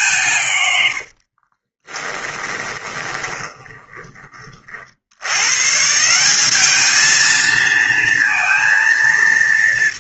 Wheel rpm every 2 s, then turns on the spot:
90, 20, 70, 210, 230.
0-4